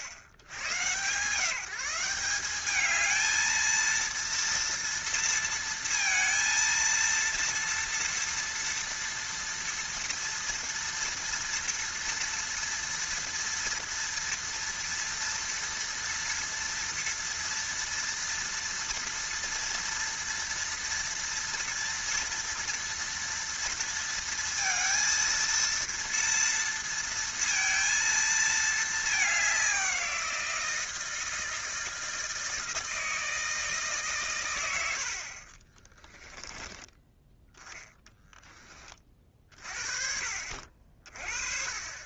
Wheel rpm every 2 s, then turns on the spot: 100, 210, 230, 230, 230, 230, 230, 230, 230, 230, 230, 230, 230, 230, 220, 170, 160, 100, 20, 30, 50.
36-38